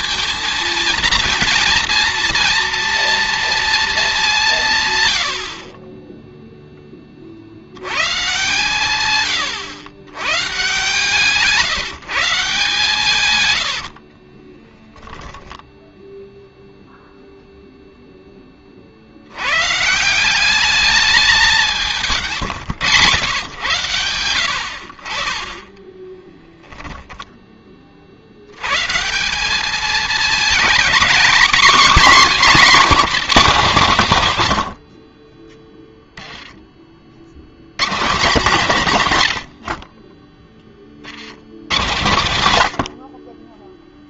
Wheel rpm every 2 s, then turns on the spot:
230, 230, 160, 10, 120, 130, 150, 10, 0, 30, 190, 140, 70, 10, 110, 240, 240, 90, 30, 170, 30, 80.
14-16 26-28